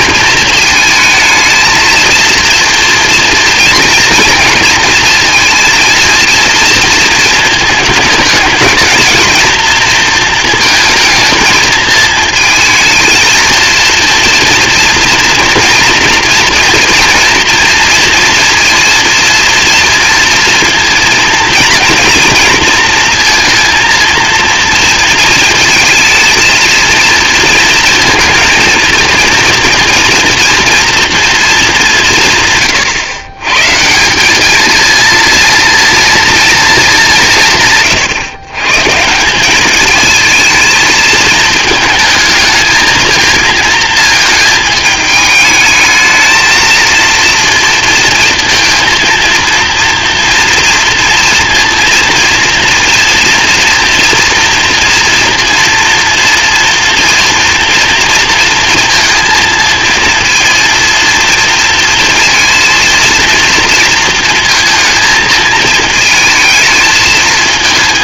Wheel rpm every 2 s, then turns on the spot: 220, 230, 230, 230, 220, 220, 220, 230, 230, 230, 230, 230, 230, 230, 230, 230, 120, 220, 230, 130, 220, 220, 220, 220, 230, 230, 230, 230, 230, 230, 230, 230, 230, 220.
none